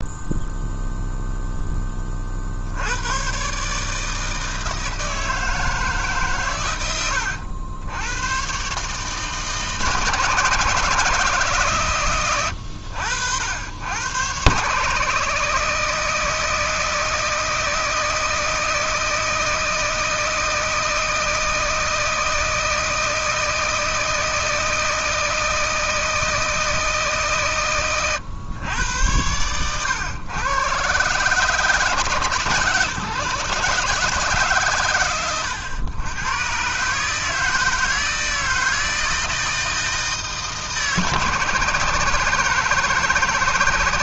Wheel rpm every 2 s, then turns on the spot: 0, 100, 160, 90, 150, 160, 80, 140, 160, 160, 160, 160, 160, 150, 100, 120, 140, 120, 130, 160, 150, 160.
6-8